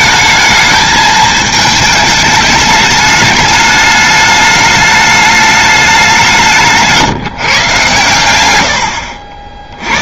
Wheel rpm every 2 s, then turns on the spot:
220, 210, 210, 150, 90.
6-8